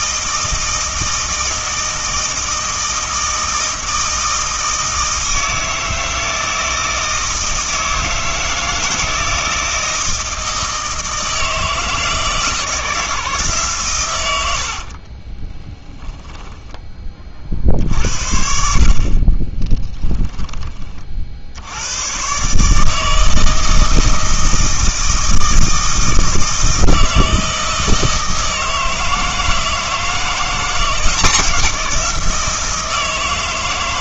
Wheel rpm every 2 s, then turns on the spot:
160, 160, 160, 160, 160, 160, 160, 70, 10, 50, 20, 150, 160, 160, 160, 170, 160.
14-16